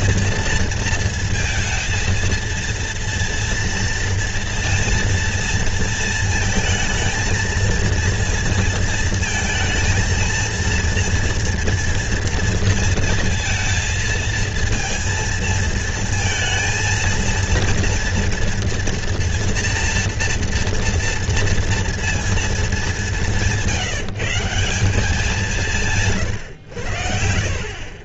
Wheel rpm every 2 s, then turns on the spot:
230, 230, 230, 230, 230, 230, 230, 230, 230, 230, 240, 210, 180, 90.
none